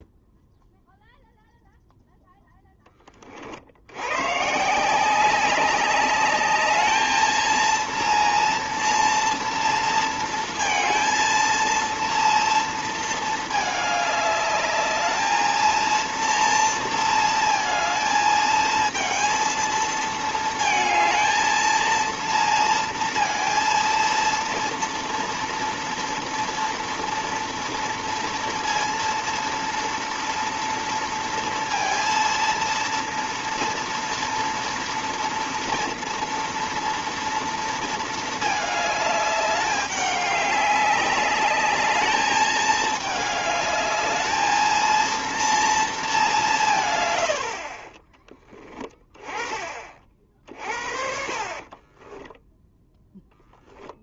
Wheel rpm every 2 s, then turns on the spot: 0, 10, 130, 210, 230, 230, 230, 210, 230, 220, 220, 230, 230, 230, 230, 230, 230, 230, 230, 220, 200, 220, 220, 190, 20, 50, 10.
52-54